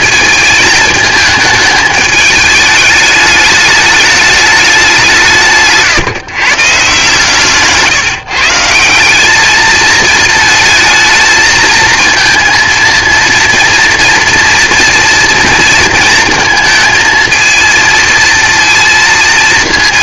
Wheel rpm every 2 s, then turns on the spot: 220, 210, 200, 140, 170, 220, 230, 230, 220, 230.
none